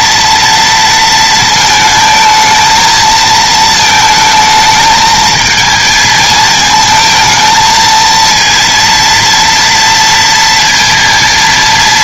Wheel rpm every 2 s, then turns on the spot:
230, 220, 220, 220, 230, 230.
none